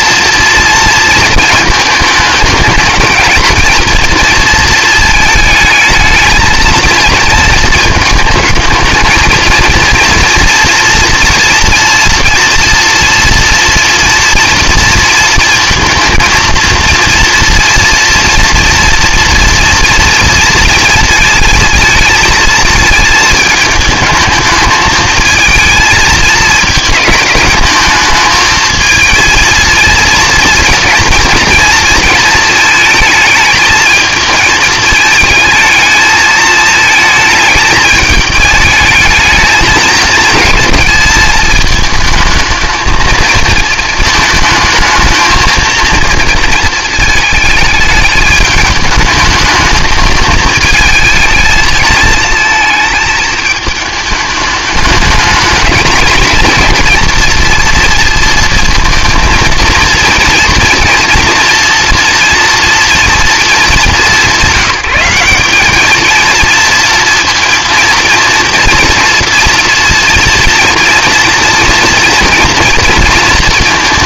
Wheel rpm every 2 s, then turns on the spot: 230, 220, 230, 220, 220, 230, 230, 230, 230, 240, 230, 220, 220, 220, 220, 230, 220, 220, 220, 220, 220, 220, 220, 230, 210, 220, 220, 210, 230, 230, 230, 230, 190, 230, 230, 230, 230.
none